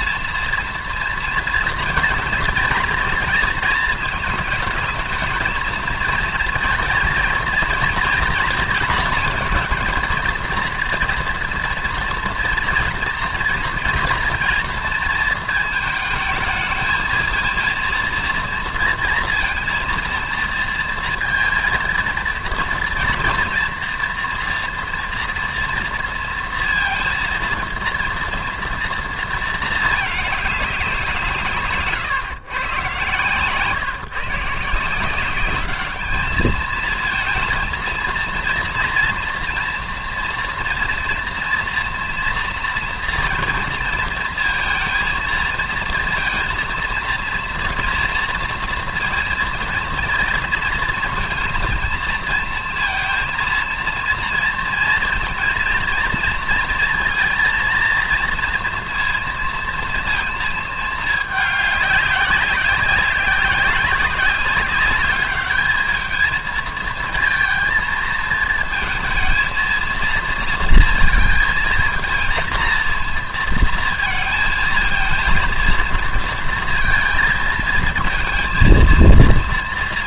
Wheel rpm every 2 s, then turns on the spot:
230, 230, 220, 230, 230, 230, 230, 230, 220, 230, 230, 230, 240, 230, 230, 180, 120, 160, 220, 240, 240, 240, 230, 230, 230, 230, 230, 230, 230, 230, 220, 190, 190, 220, 230, 230, 230, 220, 230, 230.
none